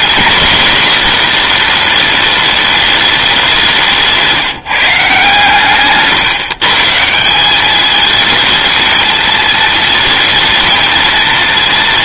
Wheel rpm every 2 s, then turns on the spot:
230, 210, 150, 150, 220, 220.
none